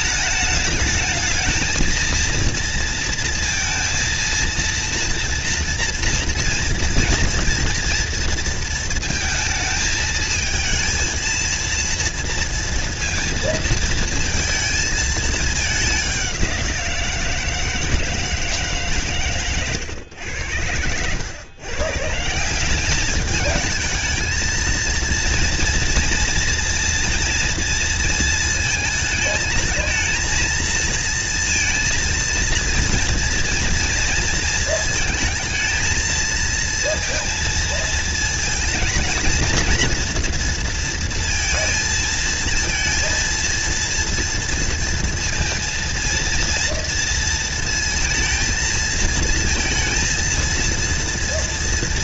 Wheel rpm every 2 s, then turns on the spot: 220, 230, 230, 230, 230, 220, 230, 230, 190, 160, 90, 180, 230, 230, 220, 230, 230, 230, 230, 220, 230, 230, 230, 230, 220, 230.
none